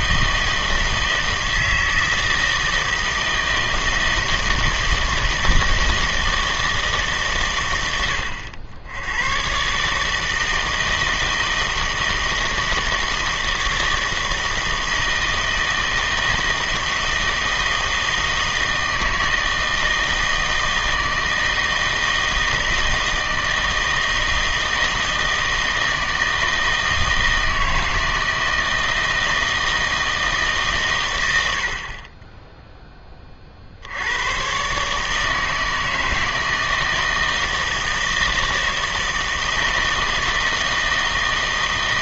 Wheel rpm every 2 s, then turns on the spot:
160, 160, 160, 160, 80, 160, 160, 160, 160, 160, 160, 160, 160, 160, 160, 140, 10, 140, 160, 160, 160.
none